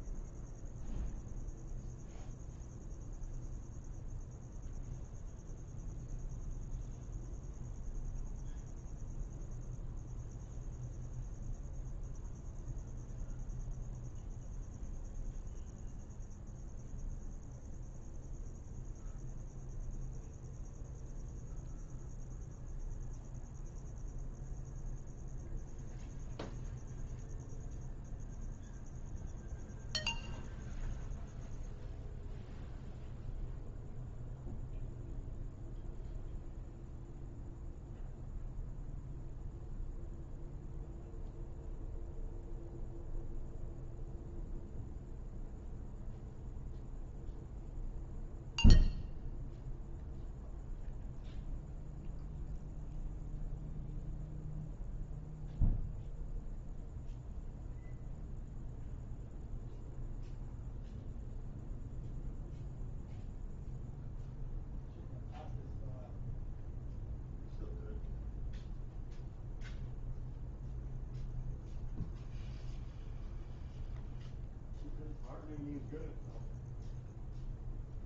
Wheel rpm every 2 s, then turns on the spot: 0, 0, 0, 0, 0, 0, 0, 0, 0, 0, 0, 0, 0, 0, 0, 0, 0, 0, 0, 0, 0, 0, 0, 0, 0, 0, 0, 0, 0, 0, 0, 0, 0, 0, 0, 0, 0, 0, 0.
none